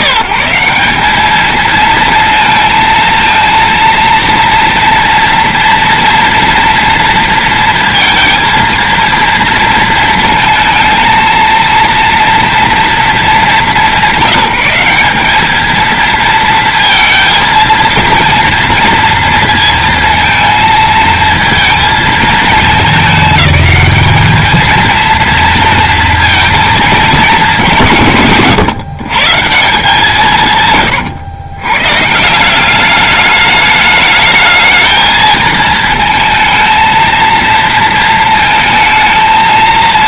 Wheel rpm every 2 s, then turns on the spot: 130, 230, 230, 230, 230, 230, 230, 190, 230, 230, 220, 220, 220, 220, 130, 140, 180, 220, 230, 220.
none